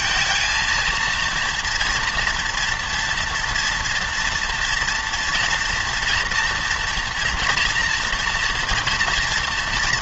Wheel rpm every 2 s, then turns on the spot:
230, 230, 230, 240, 240.
none